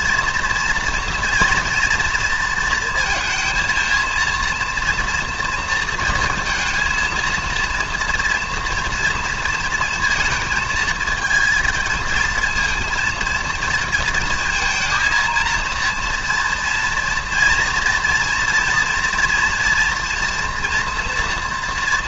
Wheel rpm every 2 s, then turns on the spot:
240, 230, 230, 230, 230, 230, 230, 220, 230, 230, 240.
none